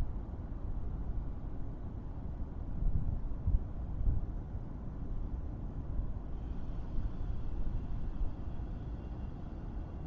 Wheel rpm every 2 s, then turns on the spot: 0, 0, 0, 0, 0.
none